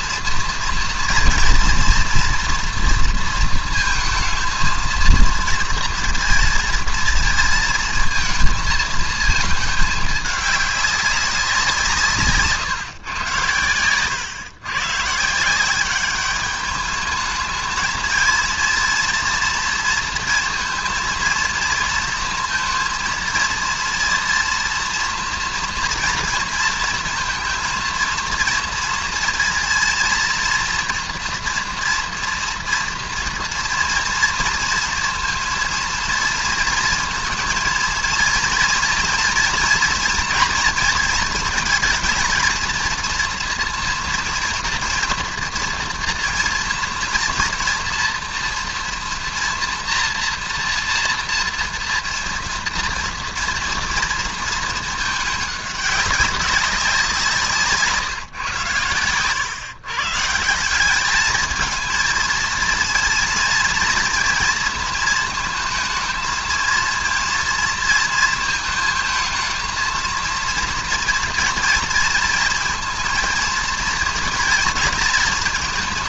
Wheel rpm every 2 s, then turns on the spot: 230, 240, 230, 230, 230, 200, 140, 120, 210, 230, 230, 230, 230, 230, 230, 230, 230, 230, 230, 230, 230, 230, 230, 230, 230, 230, 230, 220, 190, 120, 190, 230, 230, 230, 220, 230, 230, 230.
none